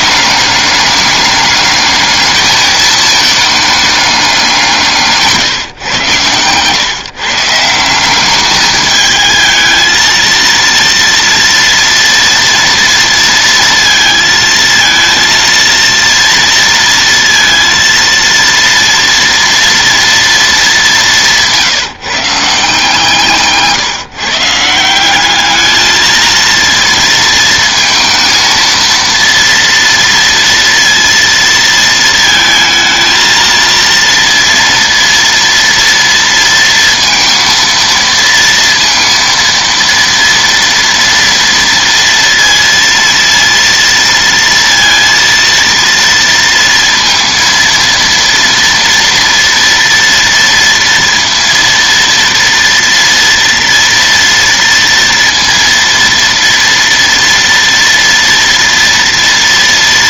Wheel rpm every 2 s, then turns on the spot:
210, 220, 150, 150, 220, 230, 230, 230, 230, 230, 180, 150, 200, 230, 230, 230, 230, 230, 230, 230, 230, 230, 230, 230, 230, 230, 230, 230, 230, 230.
none